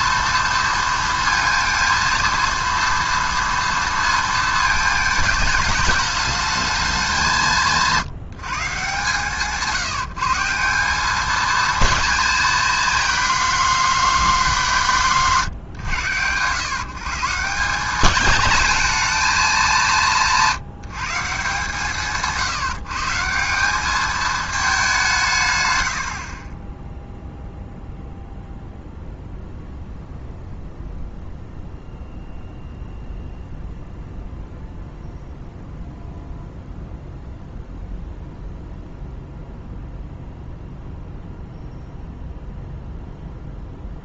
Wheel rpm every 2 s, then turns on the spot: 230, 230, 220, 210, 160, 160, 230, 220, 120, 220, 180, 160, 210, 40, 0, 0, 0, 0, 0, 0, 0, 0.
26-28